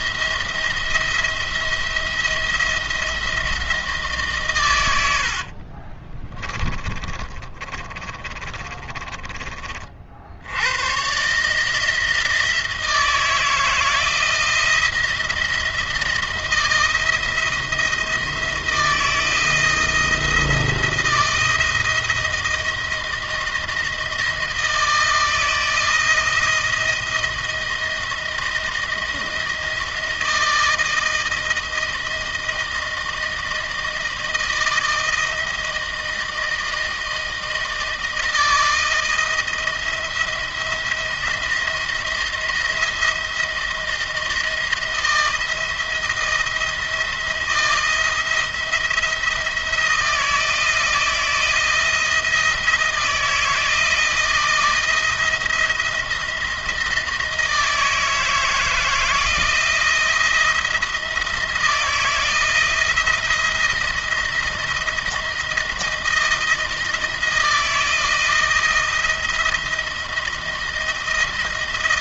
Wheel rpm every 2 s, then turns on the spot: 170, 170, 110, 20, 20, 90, 160, 170, 170, 160, 170, 160, 160, 160, 170, 160, 160, 160, 160, 160, 170, 170, 160, 170, 170, 170, 160, 170, 170, 160, 170, 170, 170, 160, 160, 160.
4-10